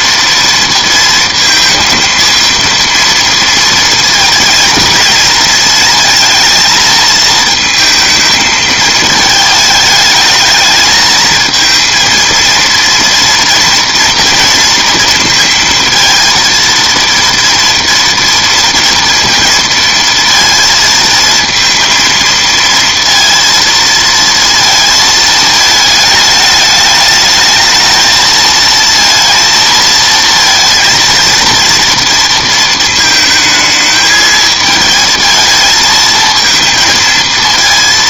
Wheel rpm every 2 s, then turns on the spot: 230, 230, 230, 220, 220, 220, 230, 230, 230, 230, 230, 230, 230, 210, 230, 230, 230, 220, 230.
none